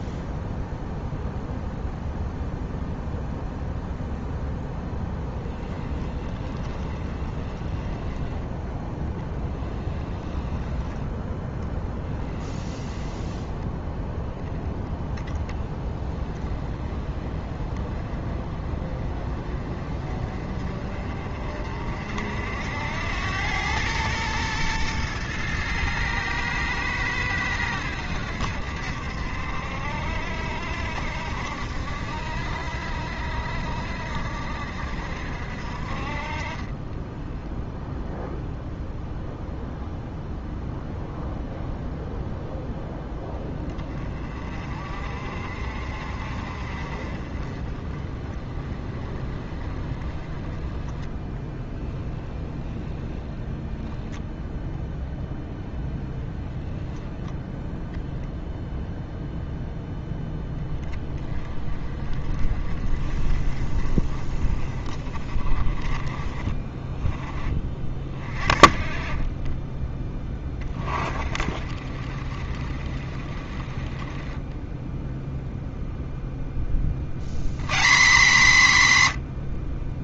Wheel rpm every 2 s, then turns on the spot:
0, 0, 10, 20, 10, 10, 10, 10, 20, 30, 40, 80, 110, 110, 70, 60, 60, 60, 20, 0, 0, 0, 40, 40, 30, 20, 10, 0, 0, 0, 10, 40, 20, 20, 30, 30, 40, 10, 20, 160.
6-8 10-14 36-38 52-54